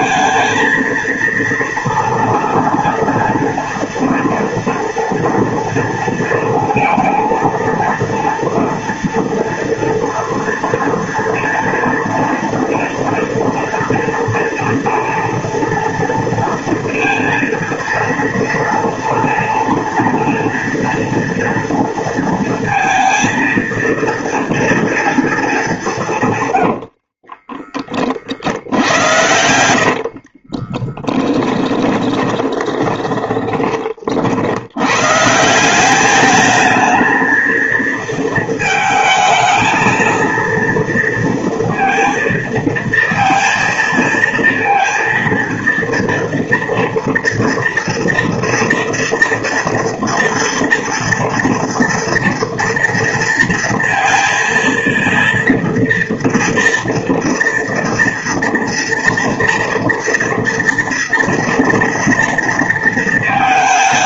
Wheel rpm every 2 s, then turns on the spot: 230, 240, 230, 230, 230, 240, 240, 240, 230, 230, 230, 230, 220, 30, 80, 10, 20, 160, 230, 220, 230, 230, 230, 230, 230, 230, 230, 230, 230, 230, 230, 220.
26-34